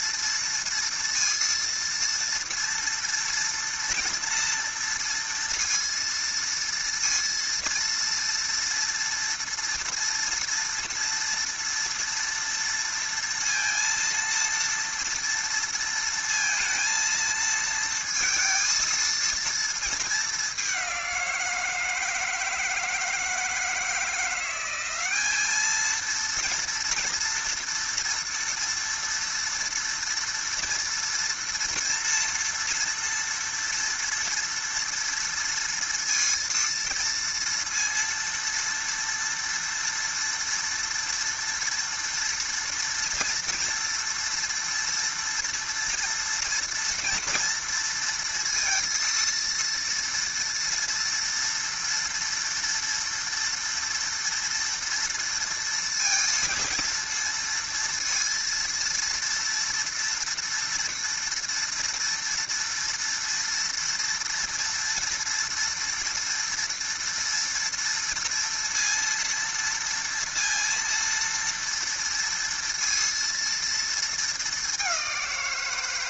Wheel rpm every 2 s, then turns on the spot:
230, 230, 230, 230, 230, 230, 230, 230, 230, 230, 200, 160, 180, 230, 230, 230, 230, 230, 230, 230, 230, 230, 230, 230, 230, 230, 230, 230, 230, 230, 230, 230, 230, 230, 230, 230, 230, 210.
none